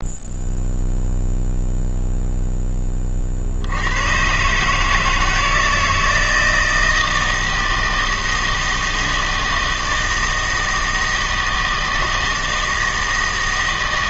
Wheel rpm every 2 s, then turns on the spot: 0, 10, 150, 160, 160, 160, 160.
none